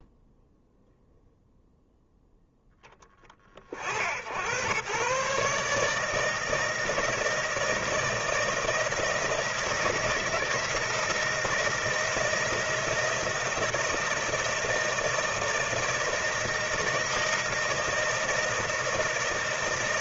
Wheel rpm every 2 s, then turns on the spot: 0, 0, 90, 160, 160, 160, 160, 160, 160, 160.
none